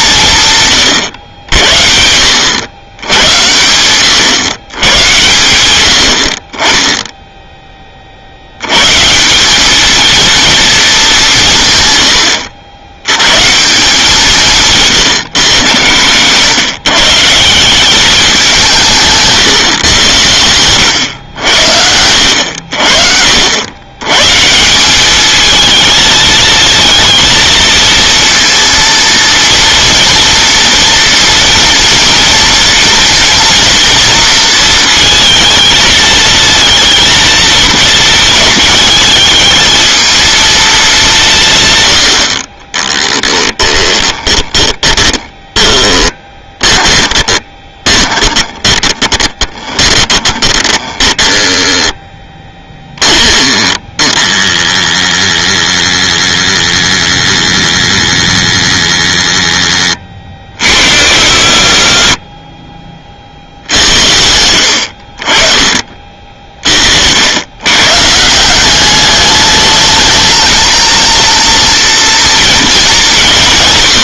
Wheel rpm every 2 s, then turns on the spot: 140, 100, 110, 20, 110, 230, 100, 150, 140, 180, 100, 80, 180, 220, 230, 230, 230, 230, 230, 220, 220, 20, 10, 20, 20, 10, 10, 10, 10, 10, 50, 30, 70, 60, 190, 220, 230.
42-52 62-64